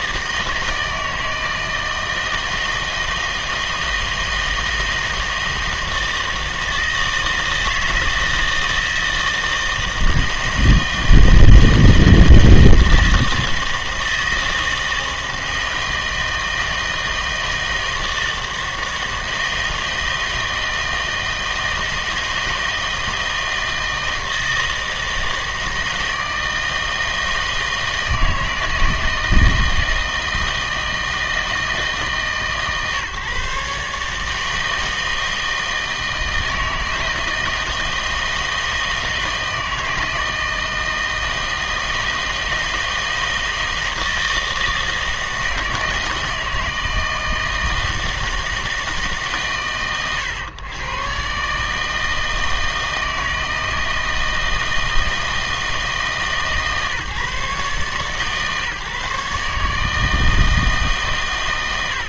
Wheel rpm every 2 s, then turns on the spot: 160, 160, 160, 160, 160, 160, 160, 160, 160, 160, 160, 160, 160, 160, 160, 160, 140, 160, 160, 160, 160, 160, 160, 160, 160, 120, 160, 160, 150, 150, 150.
none